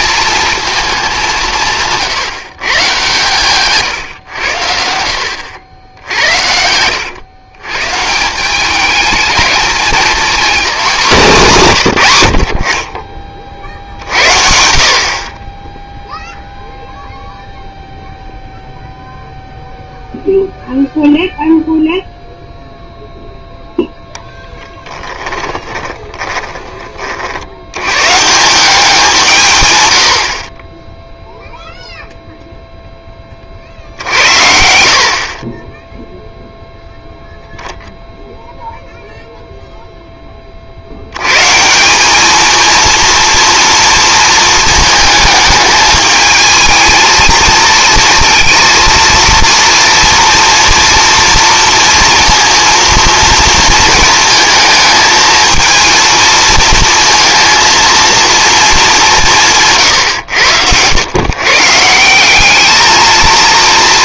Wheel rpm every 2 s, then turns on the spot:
220, 150, 90, 90, 200, 220, 40, 60, 0, 0, 0, 0, 10, 30, 180, 20, 0, 70, 0, 0, 50, 220, 220, 220, 230, 230, 230, 220, 230, 230, 90, 210.
24-26